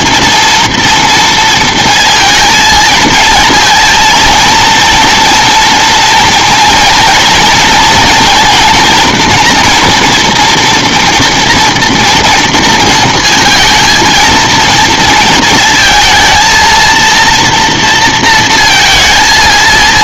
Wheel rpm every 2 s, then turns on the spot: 230, 220, 230, 230, 230, 240, 230, 230, 220, 230.
none